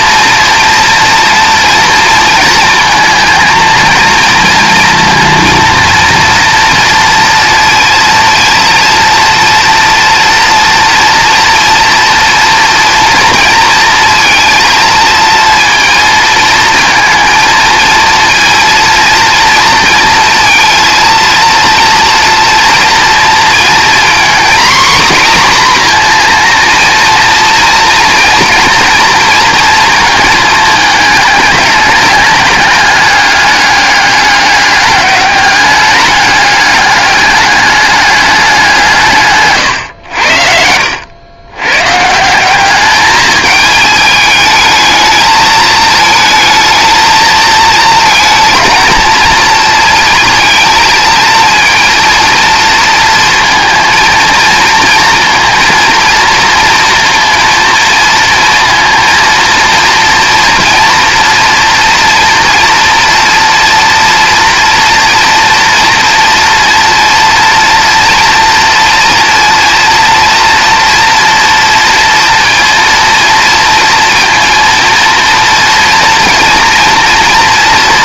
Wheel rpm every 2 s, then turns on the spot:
230, 230, 230, 240, 230, 240, 230, 230, 230, 230, 230, 230, 250, 230, 230, 220, 210, 200, 200, 170, 80, 200, 220, 220, 230, 230, 230, 230, 230, 230, 230, 230, 230, 230, 230, 230, 230, 230, 230.
none